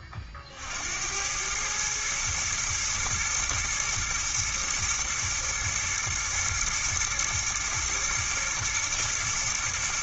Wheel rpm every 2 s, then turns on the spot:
80, 120, 120, 110, 110.
none